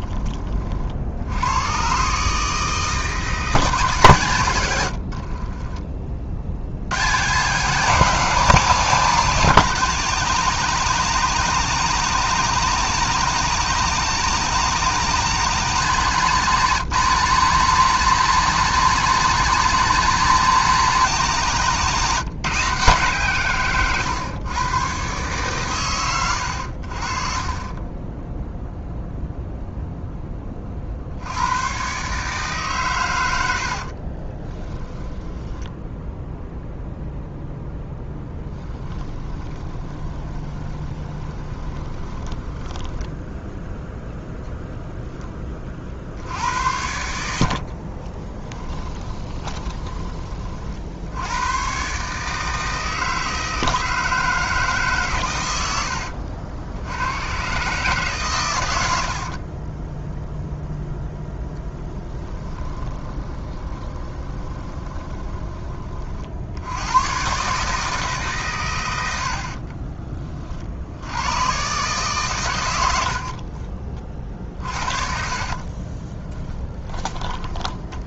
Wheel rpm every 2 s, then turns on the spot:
50, 160, 90, 90, 180, 190, 200, 190, 180, 190, 190, 160, 120, 70, 0, 40, 130, 20, 0, 10, 20, 10, 0, 80, 20, 60, 160, 150, 70, 90, 0, 20, 20, 90, 110, 60, 90, 50, 20.
4-6 34-36 38-44 48-50 62-66 74-78